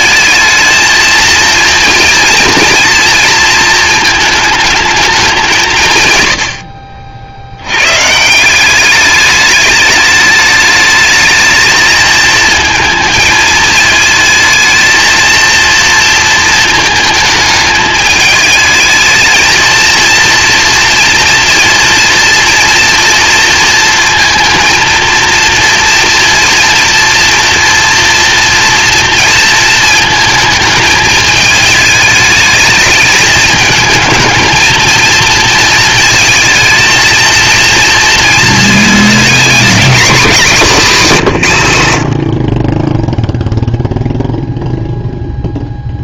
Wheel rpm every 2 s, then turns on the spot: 230, 230, 210, 60, 200, 210, 220, 220, 220, 220, 230, 230, 230, 240, 230, 220, 210, 230, 230, 220, 210, 20, 0.
none